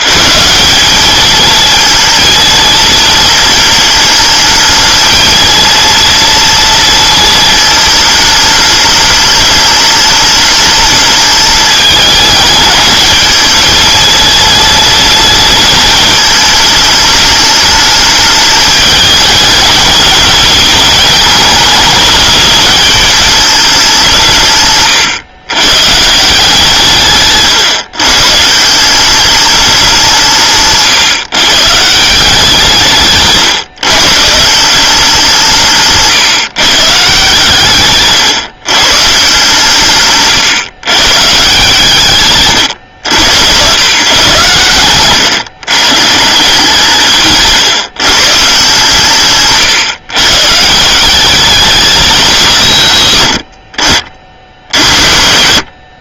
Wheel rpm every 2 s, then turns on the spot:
210, 220, 220, 230, 210, 220, 210, 230, 210, 220, 210, 210, 120, 140, 190, 160, 150, 180, 140, 140, 140, 110, 120, 160, 150, 190, 110, 90.
none